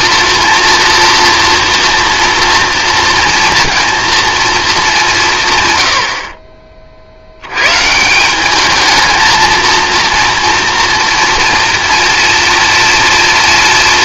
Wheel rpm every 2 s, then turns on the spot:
230, 230, 210, 40, 210, 230, 240.
none